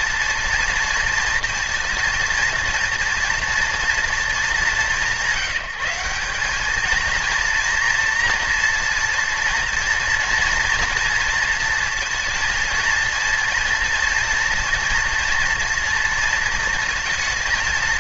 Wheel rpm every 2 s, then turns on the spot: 230, 230, 190, 220, 230, 230, 230, 230, 230.
none